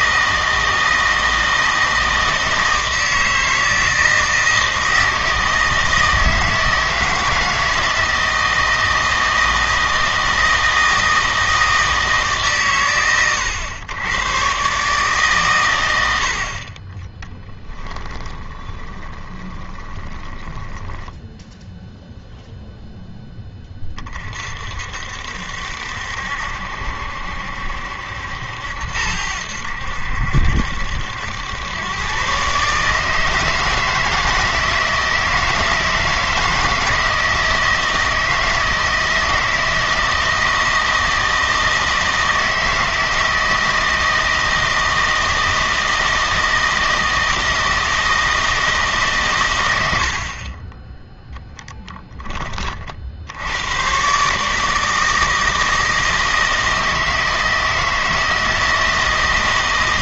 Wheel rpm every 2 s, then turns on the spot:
160, 160, 160, 160, 160, 160, 130, 130, 40, 20, 10, 0, 50, 70, 80, 70, 140, 160, 160, 160, 160, 160, 160, 160, 160, 20, 40, 150, 160, 160.
18-22